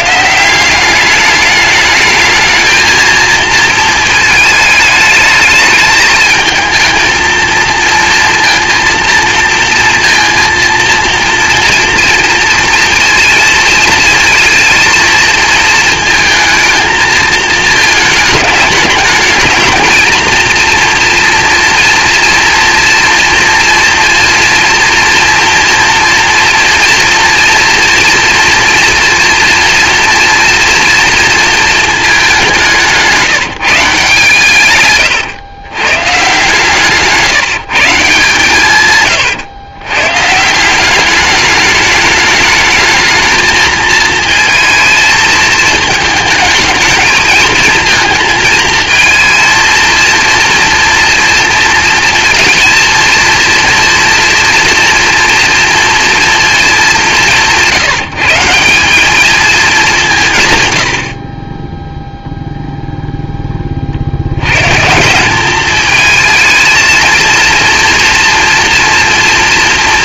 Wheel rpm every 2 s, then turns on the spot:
180, 220, 220, 220, 230, 230, 230, 220, 220, 210, 230, 240, 230, 240, 230, 230, 180, 130, 150, 140, 170, 210, 230, 220, 230, 230, 220, 230, 210, 180, 110, 0, 110, 230, 230.
34-36